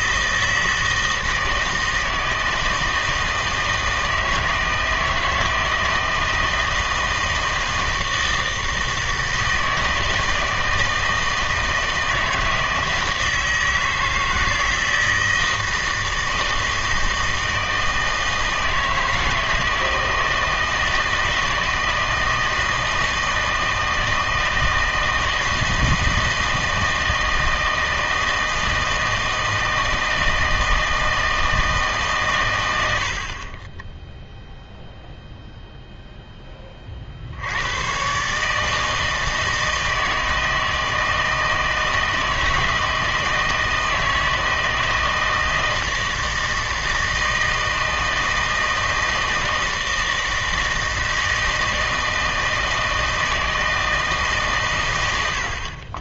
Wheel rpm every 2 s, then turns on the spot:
160, 160, 160, 160, 160, 160, 160, 160, 160, 160, 160, 160, 160, 160, 160, 160, 140, 0, 30, 160, 160, 160, 160, 160, 160, 160, 160, 120.
none